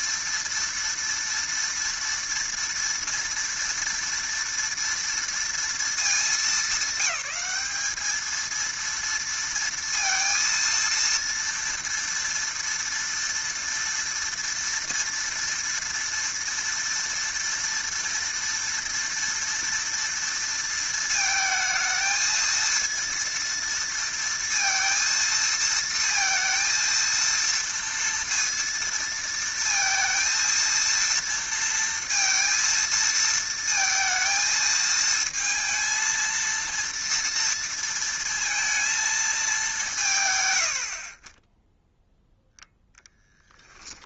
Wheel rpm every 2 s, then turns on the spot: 230, 230, 230, 210, 230, 230, 230, 230, 230, 230, 230, 230, 230, 230, 230, 230, 230, 220, 230, 230, 110, 0.
none